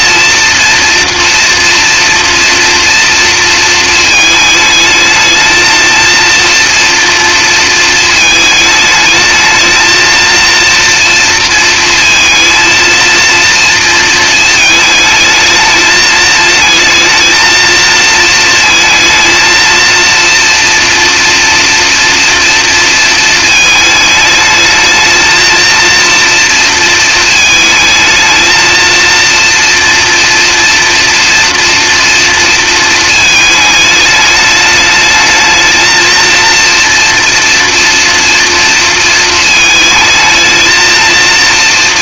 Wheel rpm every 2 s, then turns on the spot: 230, 230, 220, 230, 220, 230, 230, 220, 220, 220, 230, 230, 220, 230, 230, 230, 230, 220, 230, 230, 220.
none